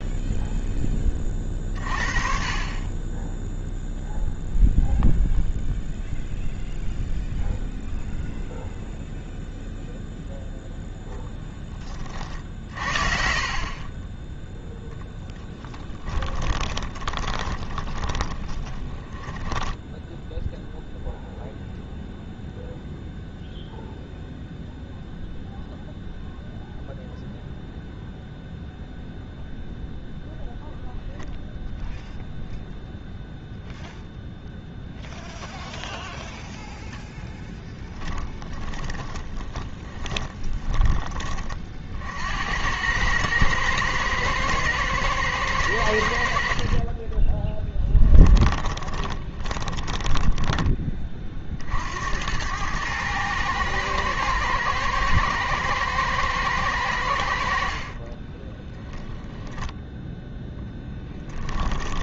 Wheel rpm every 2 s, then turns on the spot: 20, 20, 0, 0, 0, 0, 50, 0, 20, 20, 0, 0, 0, 0, 0, 0, 0, 0, 0, 20, 20, 100, 110, 30, 20, 20, 110, 120, 100, 10, 10.
12-14 16-20 38-40 48-50 58-62